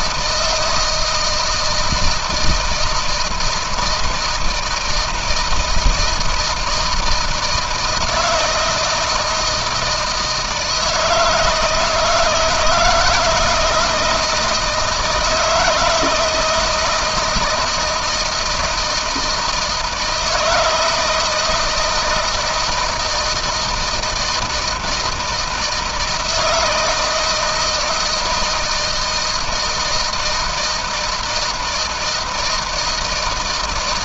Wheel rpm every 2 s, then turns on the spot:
160, 160, 160, 160, 160, 160, 170, 160, 160, 160, 160, 160, 160, 160, 160, 160, 160.
none